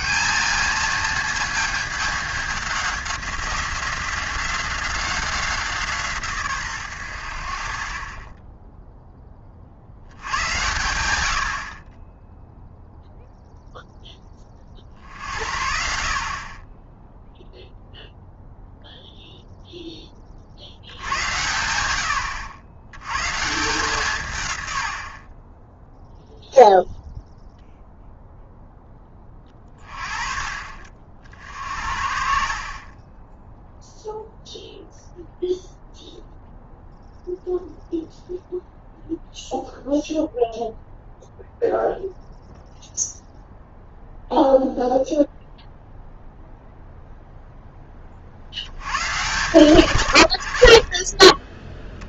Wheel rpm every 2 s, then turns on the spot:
210, 200, 180, 130, 10, 100, 0, 40, 20, 0, 60, 90, 100, 0, 0, 40, 40, 0, 0, 0, 0, 0, 0, 0, 80, 60.
32-34